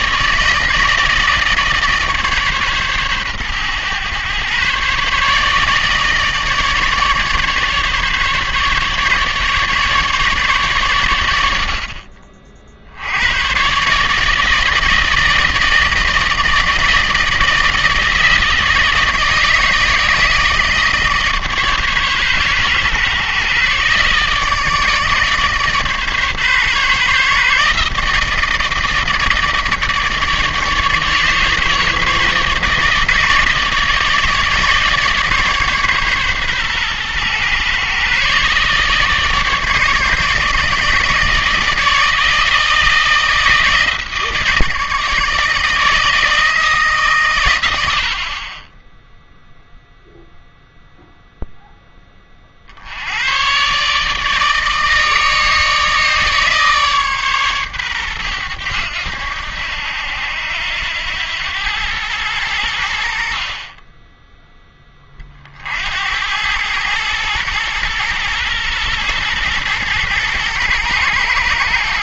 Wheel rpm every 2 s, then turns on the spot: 160, 140, 130, 150, 150, 130, 70, 160, 160, 160, 160, 120, 150, 140, 160, 150, 150, 150, 130, 140, 150, 160, 160, 160, 10, 0, 50, 160, 150, 90, 90, 80, 10, 100, 110, 110.
none